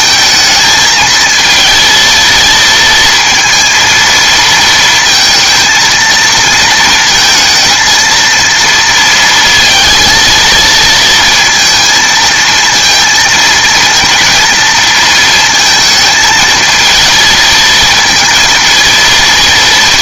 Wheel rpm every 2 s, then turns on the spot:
220, 230, 230, 230, 230, 230, 230, 230, 230, 230.
none